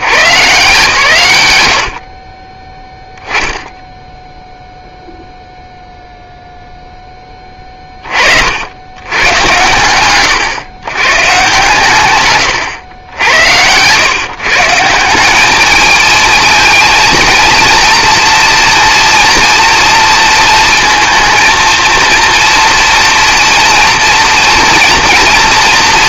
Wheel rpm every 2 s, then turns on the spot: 140, 10, 0, 0, 90, 130, 100, 160, 230, 230, 230, 240, 230.
2-4